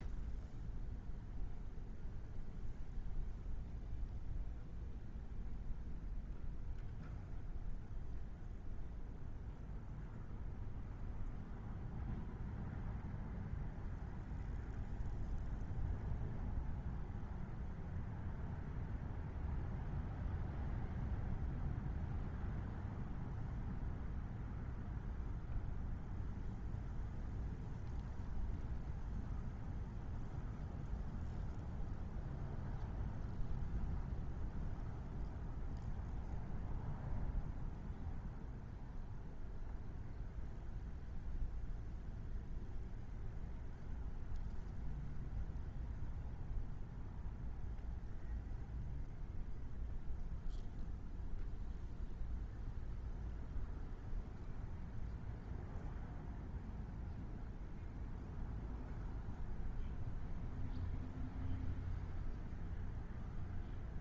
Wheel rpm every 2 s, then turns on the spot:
0, 0, 0, 0, 0, 0, 0, 0, 0, 0, 0, 0, 0, 0, 0, 0, 0, 0, 0, 0, 0, 0, 0, 0, 0, 0, 0, 0, 0, 0, 0, 0.
none